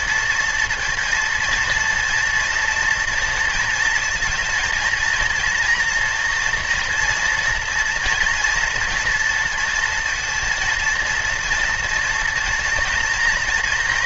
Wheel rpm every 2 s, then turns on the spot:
230, 230, 230, 240, 230, 230, 230.
none